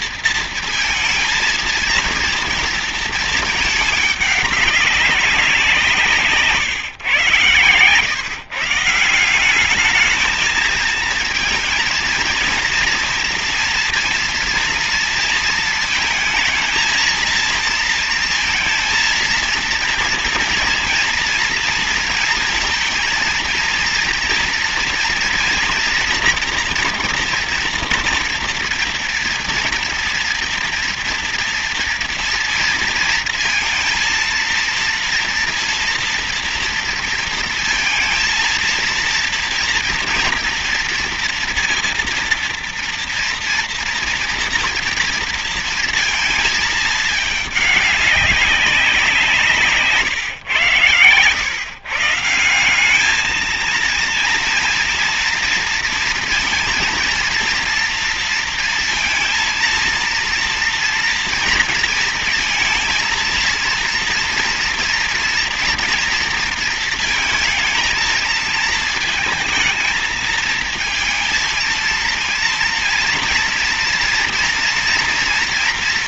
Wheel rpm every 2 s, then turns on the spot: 230, 220, 200, 130, 160, 230, 240, 230, 220, 230, 230, 230, 230, 230, 230, 230, 230, 230, 230, 230, 230, 230, 230, 220, 180, 110, 200, 230, 230, 230, 230, 230, 230, 230, 220, 230, 230, 230.
none